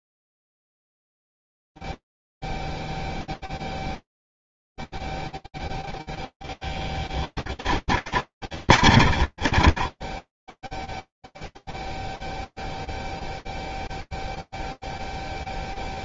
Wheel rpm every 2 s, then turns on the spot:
0, 0, 0, 0, 20, 10, 0, 0.
8-12